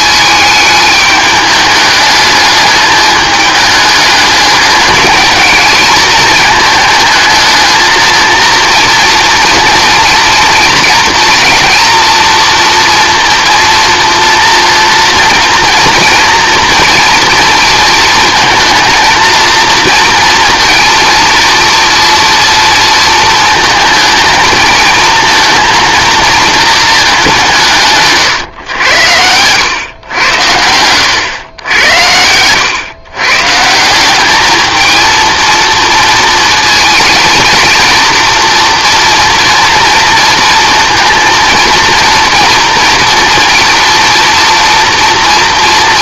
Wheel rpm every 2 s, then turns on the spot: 210, 210, 210, 220, 230, 240, 240, 230, 230, 220, 230, 230, 220, 220, 100, 90, 120, 220, 230, 230, 230, 230, 230.
none